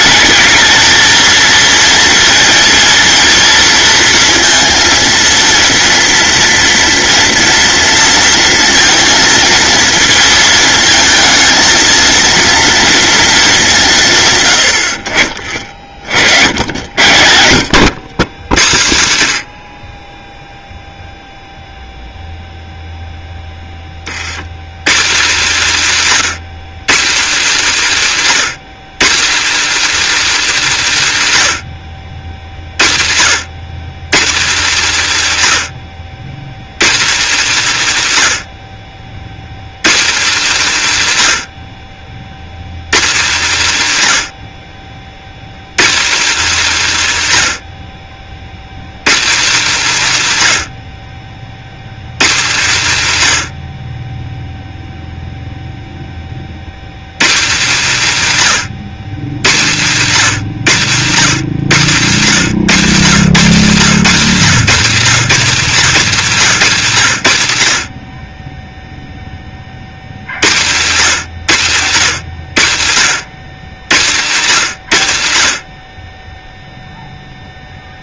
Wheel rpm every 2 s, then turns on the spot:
220, 230, 230, 230, 230, 220, 230, 60, 80, 100, 0, 0, 170, 220, 220, 200, 70, 200, 180, 60, 180, 160, 70, 180, 160, 80, 160, 0, 130, 140, 160, 170, 200, 150, 0, 140, 100, 130, 0.
none